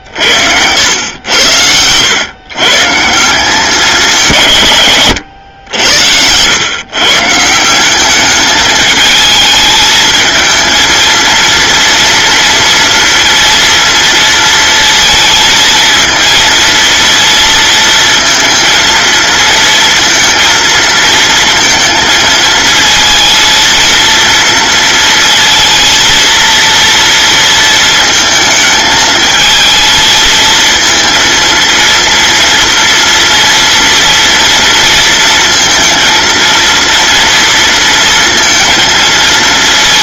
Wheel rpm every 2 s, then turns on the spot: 80, 130, 140, 120, 210, 220, 230, 230, 230, 230, 230, 230, 230, 230, 220, 220, 230, 230, 230, 230.
none